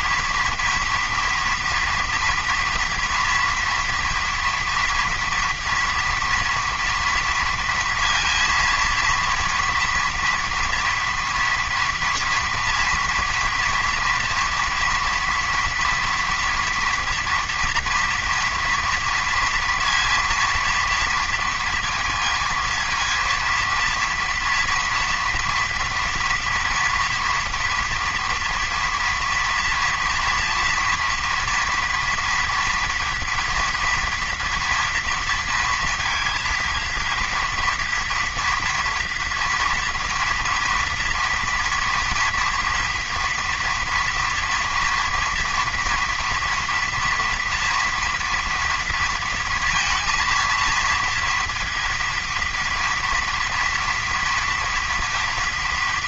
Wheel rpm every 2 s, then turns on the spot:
230, 230, 240, 230, 230, 230, 230, 240, 240, 230, 230, 230, 230, 230, 230, 240, 230, 230, 230, 240, 230, 230, 240, 230, 230, 230, 230, 230.
none